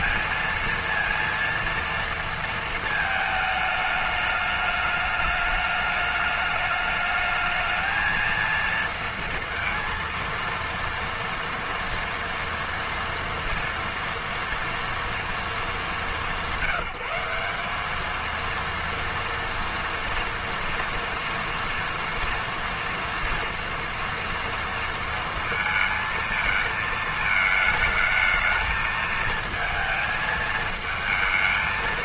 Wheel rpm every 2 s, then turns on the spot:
230, 220, 210, 210, 230, 230, 230, 230, 190, 230, 230, 230, 230, 220, 220, 220.
none